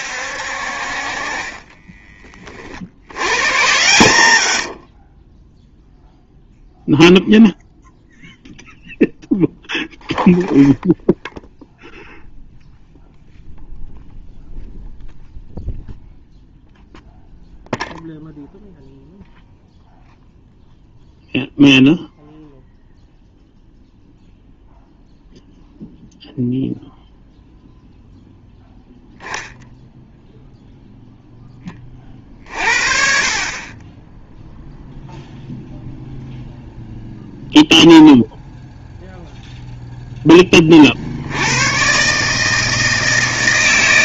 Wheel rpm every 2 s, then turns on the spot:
60, 30, 70, 0, 0, 0, 0, 0, 0, 0, 0, 0, 0, 0, 0, 0, 50, 0, 0, 0, 20, 160.
none